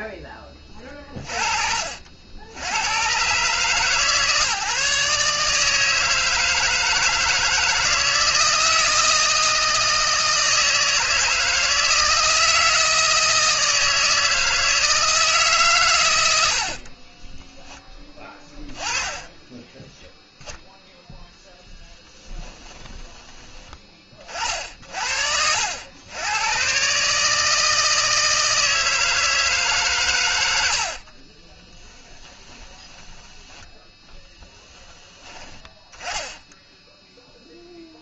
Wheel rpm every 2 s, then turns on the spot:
30, 90, 150, 160, 160, 160, 160, 160, 60, 20, 10, 10, 50, 120, 160, 100, 10, 10, 0.
16-20 22-24 32-34